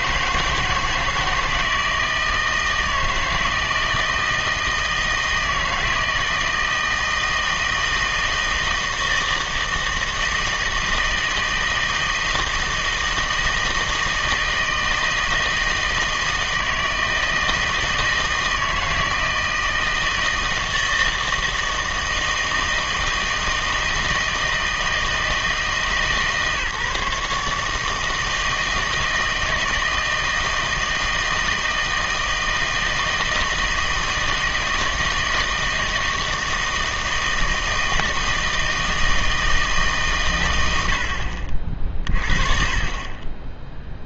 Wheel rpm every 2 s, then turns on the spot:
160, 160, 160, 160, 160, 160, 160, 160, 160, 160, 160, 160, 160, 150, 160, 160, 160, 160, 160, 160, 100, 40.
none